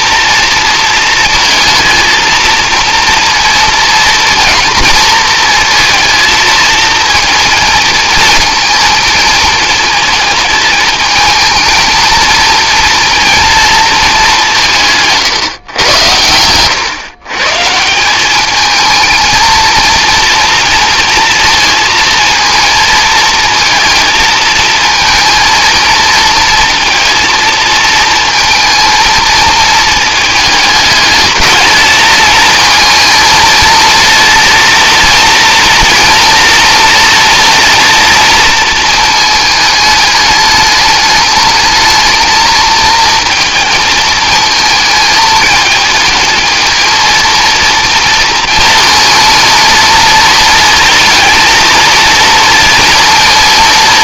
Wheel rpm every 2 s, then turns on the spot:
230, 230, 230, 230, 220, 220, 240, 150, 130, 220, 230, 230, 230, 230, 220, 210, 230, 230, 230, 220, 210, 220, 220, 230, 230, 230, 230.
none